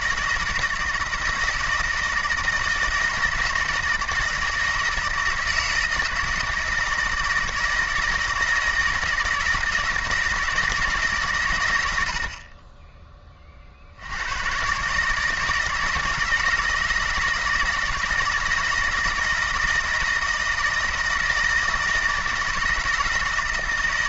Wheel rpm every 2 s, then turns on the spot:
160, 160, 160, 160, 160, 160, 20, 130, 160, 160, 160, 160.
none